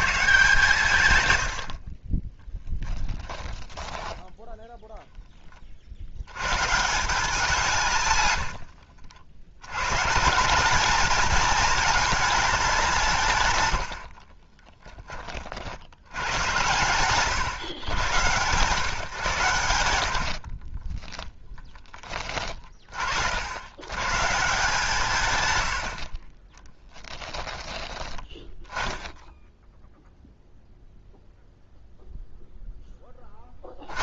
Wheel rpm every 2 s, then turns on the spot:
150, 10, 0, 140, 80, 210, 190, 30, 130, 140, 40, 40, 160, 10, 10, 0, 10.
2-4 8-10 20-22 26-28